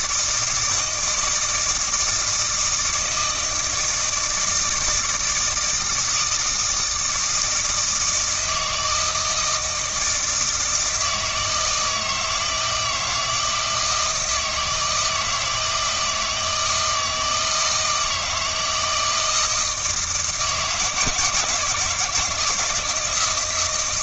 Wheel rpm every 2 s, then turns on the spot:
160, 160, 170, 160, 160, 160, 160, 160, 160, 160, 160, 160.
none